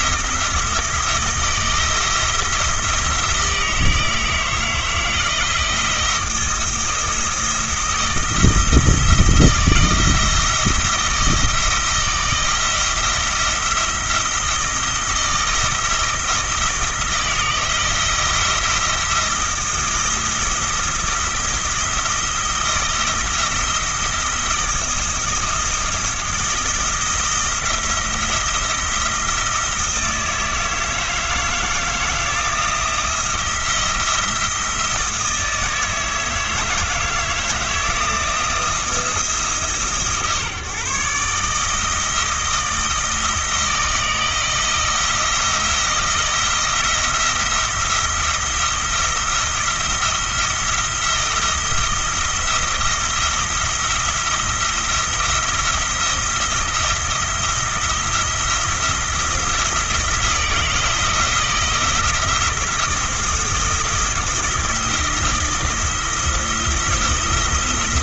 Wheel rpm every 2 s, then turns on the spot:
160, 160, 160, 160, 160, 160, 170, 170, 160, 170, 160, 160, 170, 170, 170, 160, 170, 160, 160, 170, 140, 160, 170, 170, 170, 170, 170, 170, 170, 170, 170, 170, 170, 170.
none